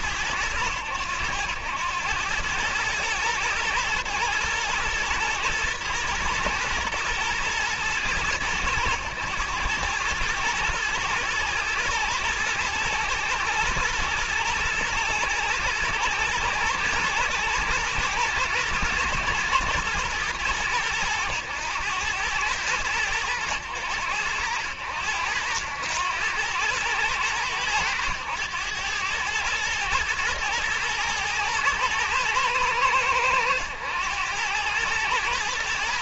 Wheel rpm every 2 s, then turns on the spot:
90, 110, 120, 110, 110, 110, 110, 110, 120, 120, 110, 110, 90, 100, 100, 120, 110, 100.
none